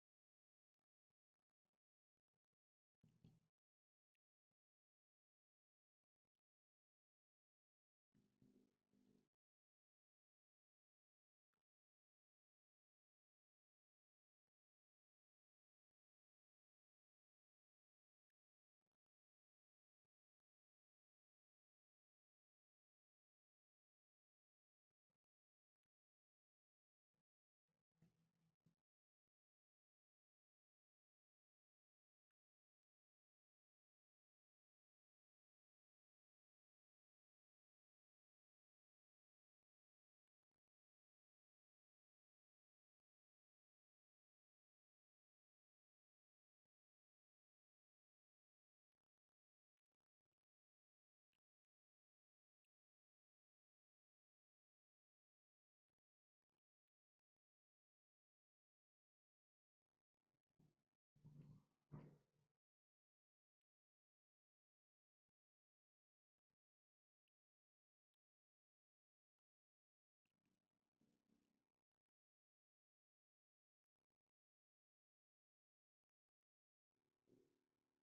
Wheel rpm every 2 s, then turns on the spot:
0, 0, 0, 0, 0, 0, 0, 0, 0, 0, 0, 0, 0, 0, 0, 0, 0, 0, 0, 0, 0, 0, 0, 0, 0, 0, 0, 0, 0, 0, 0, 0, 0, 0, 0, 0, 0, 0, 0.
none